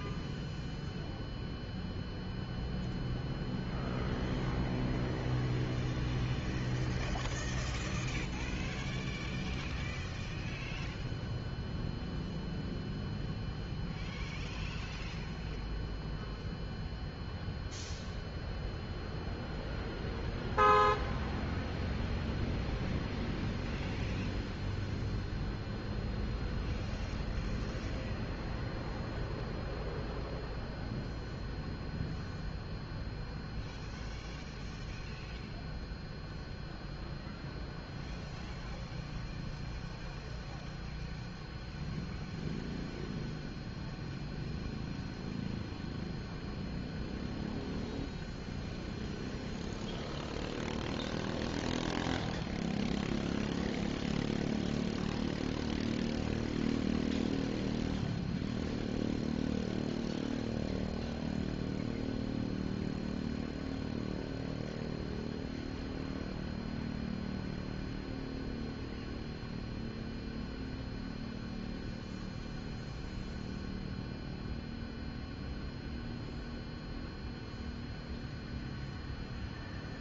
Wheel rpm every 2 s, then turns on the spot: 0, 0, 0, 0, 0, 0, 0, 0, 0, 0, 0, 0, 0, 0, 0, 0, 0, 0, 0, 0, 0, 0, 0, 0, 0, 0, 0, 0, 0, 0, 0, 0, 0, 0, 0, 0, 0, 0, 0, 0.
none